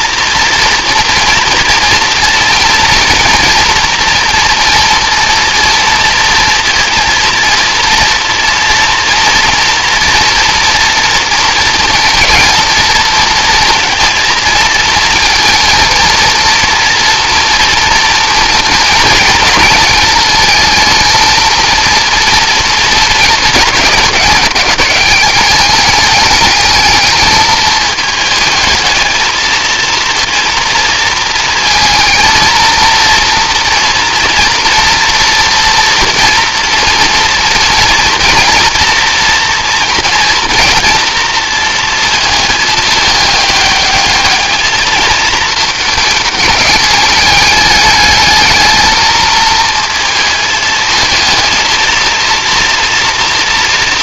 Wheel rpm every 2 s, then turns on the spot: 230, 230, 230, 230, 230, 230, 230, 230, 230, 230, 220, 230, 190, 210, 220, 230, 230, 230, 230, 230, 230, 220, 210, 210, 220, 230, 230.
none